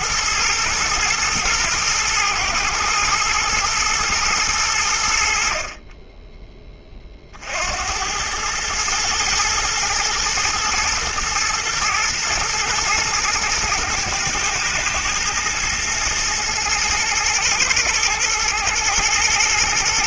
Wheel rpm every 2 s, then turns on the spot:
110, 120, 90, 20, 110, 120, 110, 120, 110, 110.
none